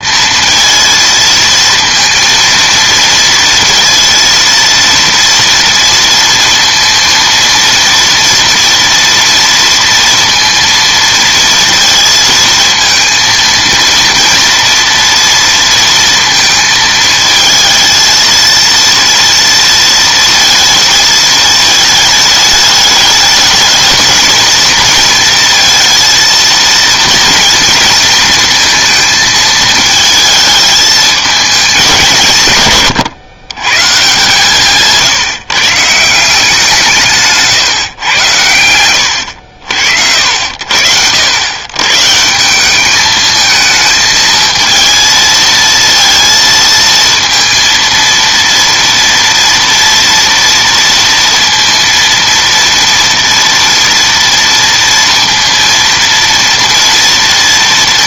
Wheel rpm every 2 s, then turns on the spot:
230, 230, 230, 230, 240, 230, 230, 230, 230, 230, 220, 210, 230, 230, 230, 220, 130, 150, 180, 100, 80, 190, 220, 230, 230, 230, 230, 230, 230.
none